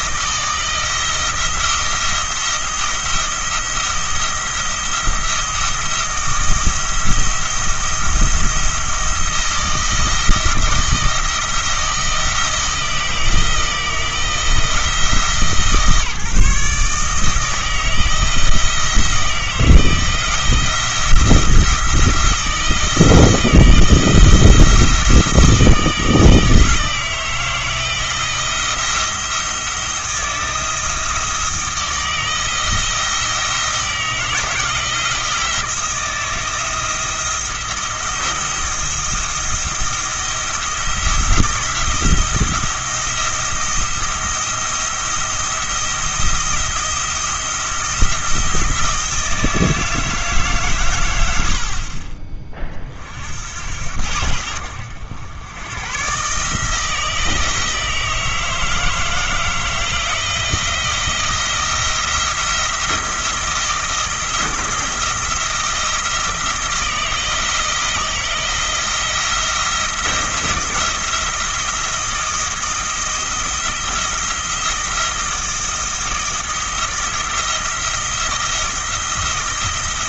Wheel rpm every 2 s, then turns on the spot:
170, 170, 170, 170, 170, 170, 170, 160, 150, 160, 170, 160, 160, 160, 170, 160, 170, 160, 170, 160, 160, 170, 170, 170, 170, 110, 40, 80, 160, 160, 170, 170, 170, 160, 170, 170, 170, 170, 170, 160.
none